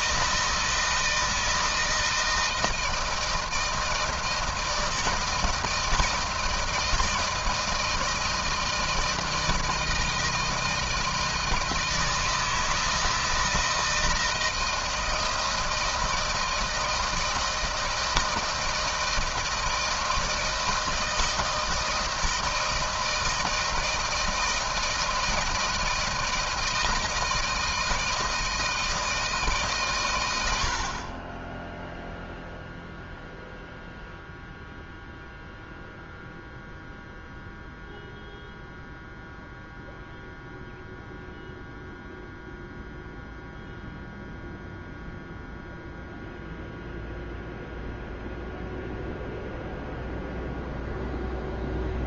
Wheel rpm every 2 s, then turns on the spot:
160, 160, 160, 160, 170, 160, 160, 160, 160, 160, 160, 160, 160, 160, 160, 90, 0, 0, 0, 0, 0, 0, 0, 0, 0, 0.
none